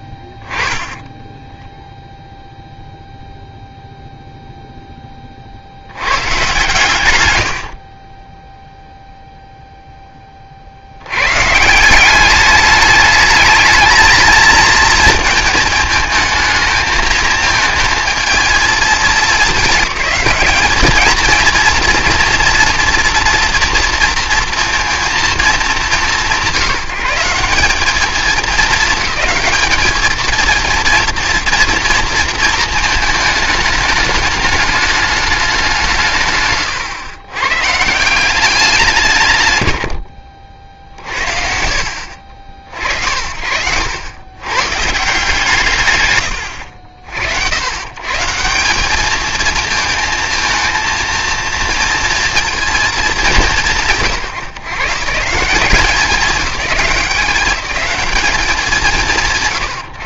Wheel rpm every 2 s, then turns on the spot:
10, 0, 0, 130, 0, 70, 200, 230, 220, 220, 210, 230, 230, 160, 220, 230, 220, 210, 130, 180, 60, 70, 150, 80, 190, 220, 220, 140, 180, 200.
none